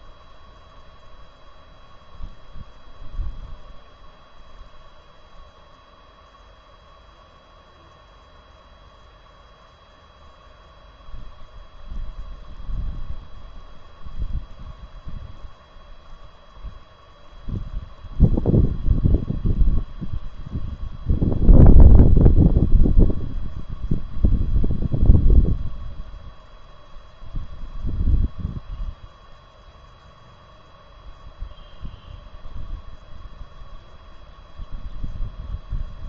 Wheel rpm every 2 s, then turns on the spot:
0, 0, 0, 0, 0, 0, 0, 0, 0, 0, 0, 0, 0, 0, 0, 0, 0, 0.
none